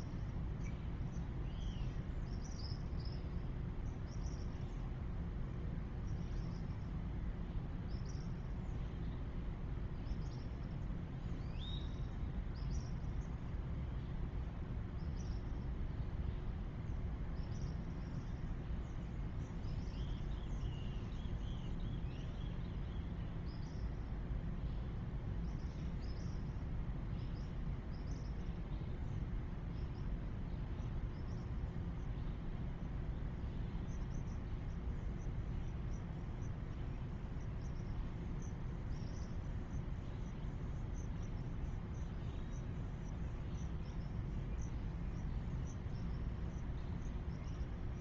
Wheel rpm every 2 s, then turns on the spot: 0, 0, 0, 0, 0, 0, 0, 0, 0, 0, 0, 0, 0, 0, 0, 0, 0, 0, 0, 0, 0, 0, 0, 0.
none